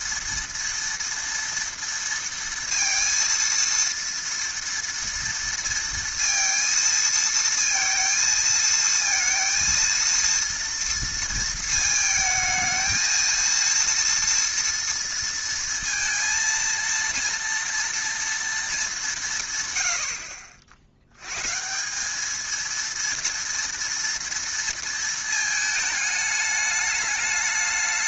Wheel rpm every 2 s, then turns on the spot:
230, 230, 230, 230, 220, 230, 220, 230, 230, 230, 60, 220, 230, 210.
none